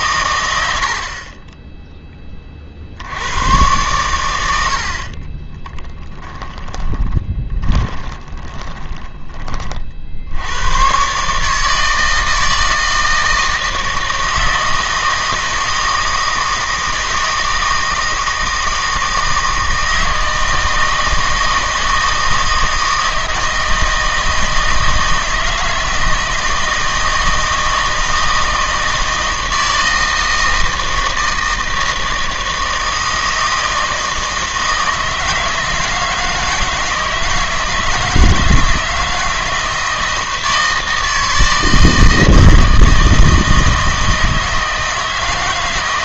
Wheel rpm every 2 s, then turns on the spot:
80, 50, 70, 20, 10, 120, 160, 160, 160, 160, 160, 160, 160, 160, 160, 160, 160, 160, 160, 160, 160, 160, 160.
4-10